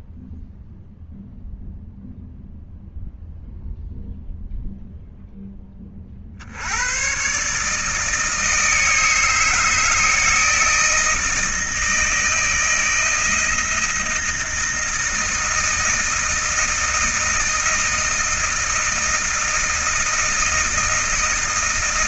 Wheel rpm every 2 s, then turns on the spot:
0, 0, 0, 90, 150, 160, 160, 160, 160, 160, 160.
none